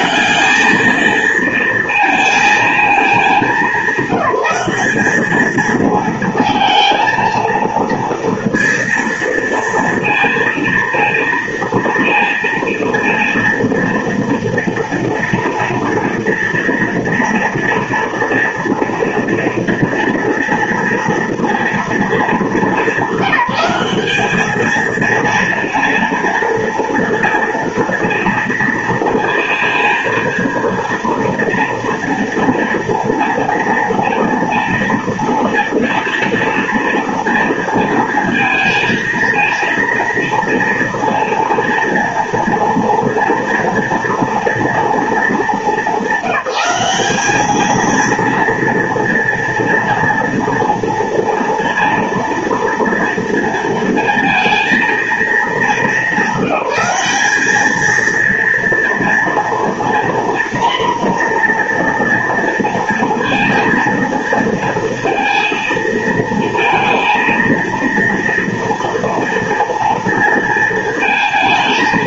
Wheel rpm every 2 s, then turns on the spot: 210, 220, 200, 230, 230, 230, 230, 230, 230, 240, 230, 220, 210, 230, 230, 230, 230, 230, 230, 230, 230, 230, 230, 200, 230, 230, 230, 230, 210, 230, 240, 240, 230, 230, 230, 230.
none